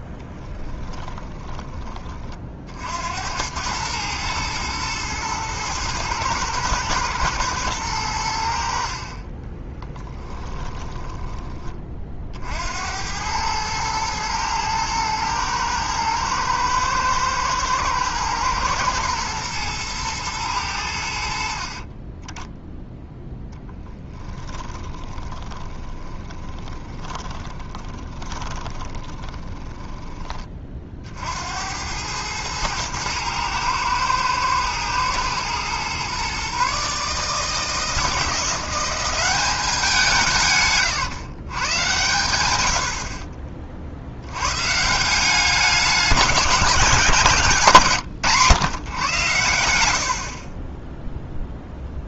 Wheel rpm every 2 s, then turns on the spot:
20, 60, 110, 110, 60, 20, 70, 110, 110, 110, 100, 0, 20, 20, 20, 40, 110, 110, 140, 180, 140, 90, 130, 200, 120, 50.
0-2 10-12 24-30